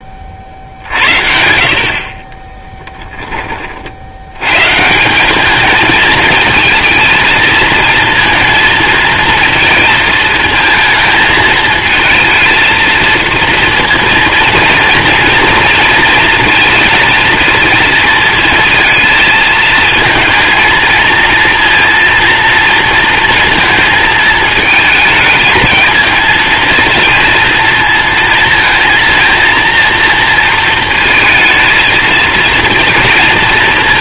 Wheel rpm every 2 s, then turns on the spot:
60, 10, 170, 220, 230, 220, 230, 230, 230, 220, 230, 230, 220, 230, 230, 230, 230.
none